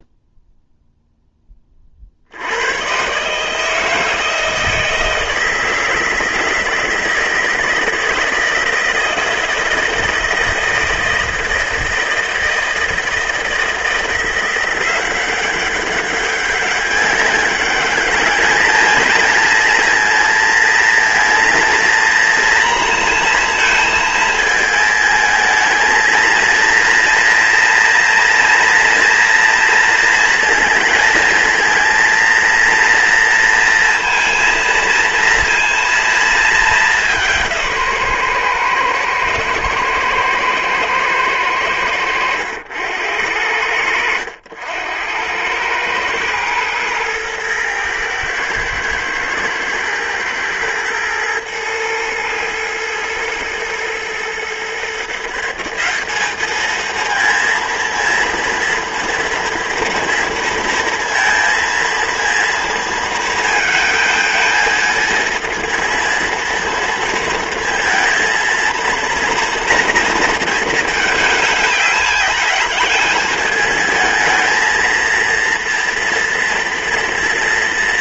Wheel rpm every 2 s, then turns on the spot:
0, 110, 160, 160, 160, 160, 160, 180, 200, 220, 220, 230, 220, 230, 230, 230, 230, 230, 190, 120, 120, 80, 90, 110, 110, 110, 110, 140, 220, 230, 230, 230, 220, 230, 230, 220, 210, 230, 230.
none